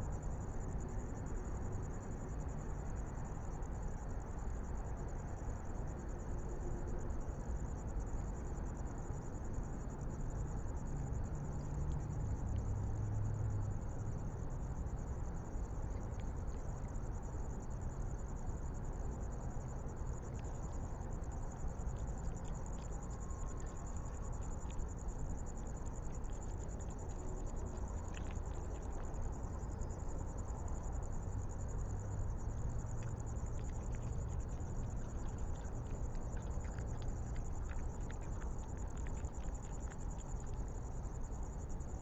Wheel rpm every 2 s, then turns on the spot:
0, 0, 0, 0, 0, 0, 0, 0, 0, 0, 0, 0, 0, 0, 0, 0, 0, 0, 0, 0, 0.
none